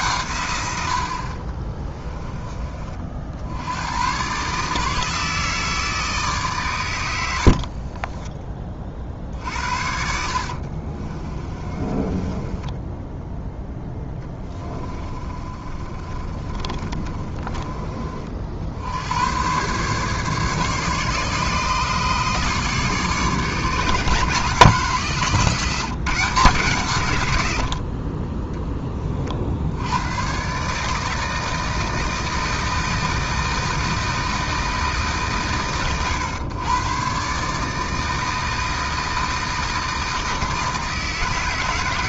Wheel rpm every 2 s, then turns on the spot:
80, 40, 150, 110, 40, 40, 10, 20, 20, 70, 140, 150, 160, 130, 20, 140, 160, 150, 110, 160, 160.
10-18